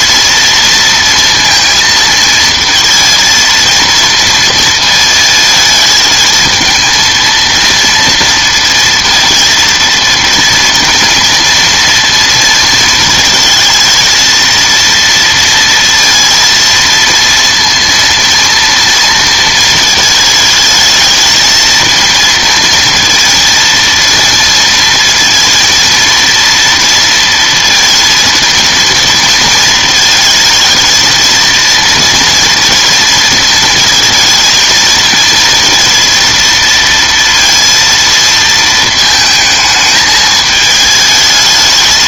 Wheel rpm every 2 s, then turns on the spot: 230, 220, 230, 230, 230, 230, 220, 230, 230, 230, 220, 230, 230, 230, 230, 220, 230, 230, 230, 220, 210.
none